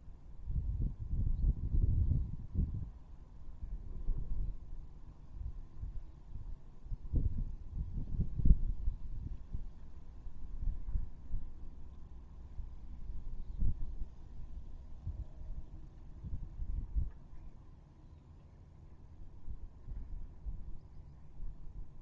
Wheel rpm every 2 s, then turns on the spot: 0, 0, 0, 0, 0, 0, 0, 0, 0, 0, 0.
none